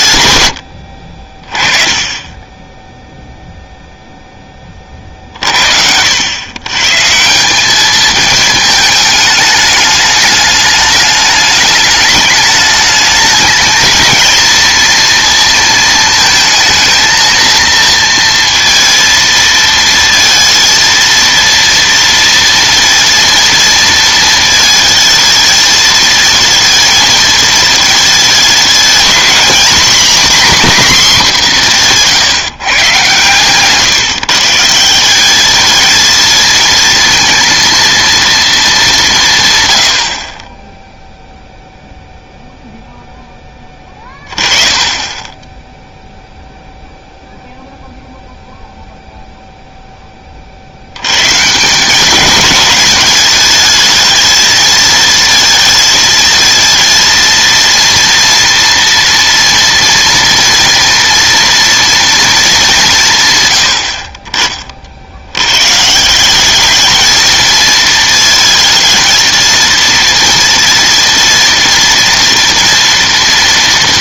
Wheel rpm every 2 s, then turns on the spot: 90, 10, 30, 130, 220, 210, 210, 230, 220, 230, 230, 230, 220, 220, 220, 250, 140, 160, 230, 210, 10, 0, 20, 0, 0, 50, 220, 220, 230, 230, 230, 210, 40, 210, 230, 230, 230.
none